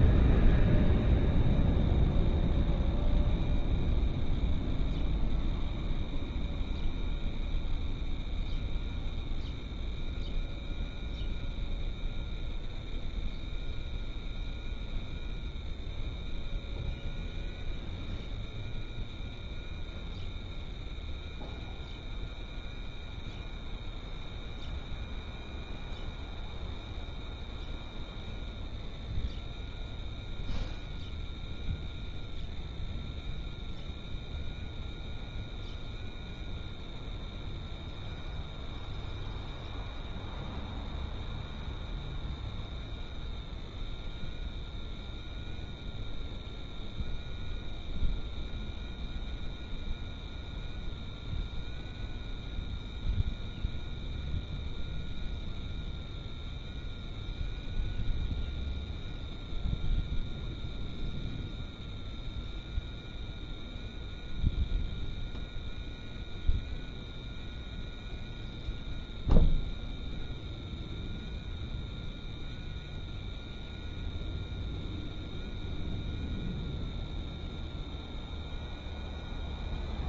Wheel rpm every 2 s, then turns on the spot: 0, 0, 0, 0, 0, 0, 0, 0, 0, 0, 0, 0, 0, 0, 0, 0, 0, 0, 0, 0, 0, 0, 0, 0, 0, 0, 0, 0, 0, 0, 0, 0, 0, 0, 0, 0, 0, 0, 0, 0.
none